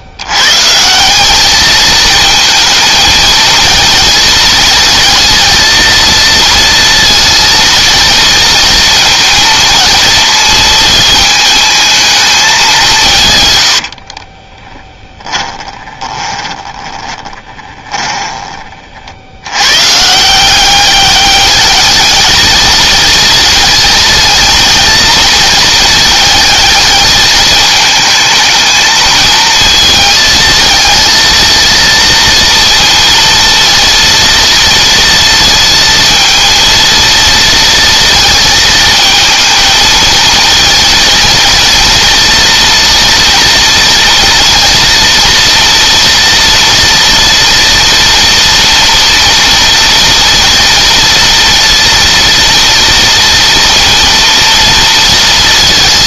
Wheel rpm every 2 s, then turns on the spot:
140, 220, 230, 230, 230, 230, 200, 20, 20, 30, 180, 220, 230, 220, 220, 220, 230, 230, 230, 230, 230, 230, 230, 230, 230, 230, 230, 230.
14-18